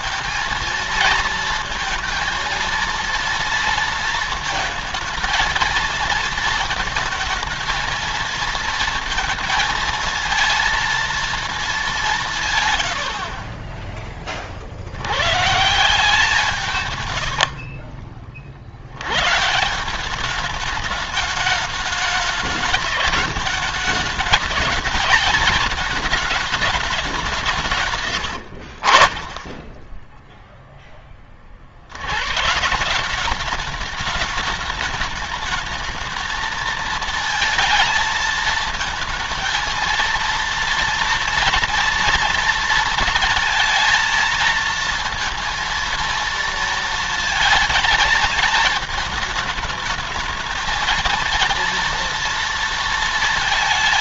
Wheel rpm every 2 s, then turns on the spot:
230, 230, 230, 220, 220, 230, 130, 40, 150, 50, 200, 200, 210, 210, 80, 0, 130, 210, 220, 220, 230, 230, 230, 230, 220, 220, 230.
16-18